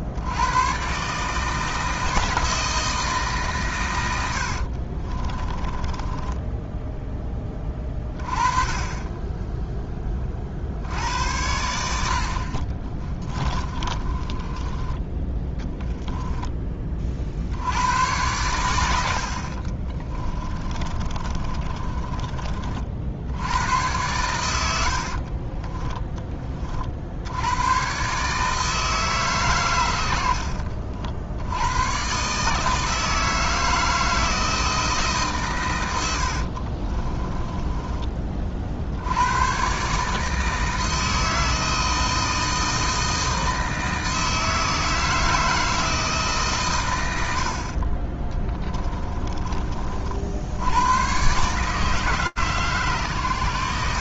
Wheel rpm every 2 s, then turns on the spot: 130, 160, 40, 10, 20, 80, 20, 20, 20, 90, 30, 50, 80, 50, 150, 60, 160, 160, 40, 60, 160, 160, 160, 110, 20, 110, 130.
4-6 12-16 20-22 24-26 36-38 48-50